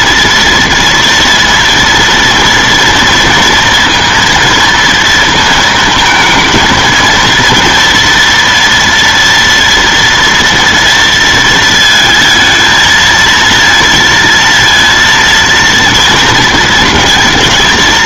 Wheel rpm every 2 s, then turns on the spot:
230, 230, 230, 220, 230, 230, 230, 230, 230.
none